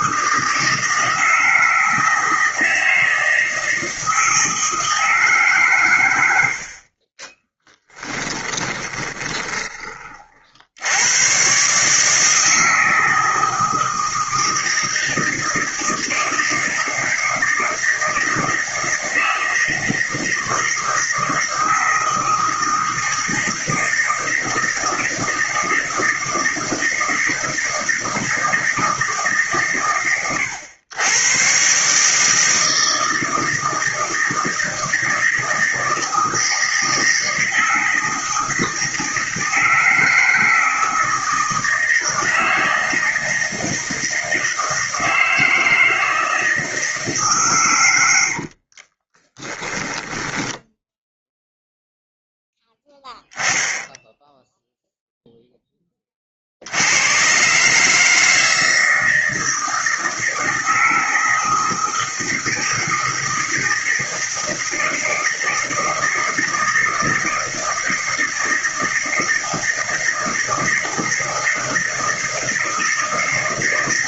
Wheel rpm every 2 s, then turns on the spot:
160, 160, 160, 50, 20, 80, 160, 160, 160, 160, 160, 160, 160, 160, 160, 100, 160, 160, 160, 160, 160, 160, 160, 160, 40, 10, 10, 0, 80, 160, 160, 160, 160, 160, 160, 160, 160.
6-10 48-50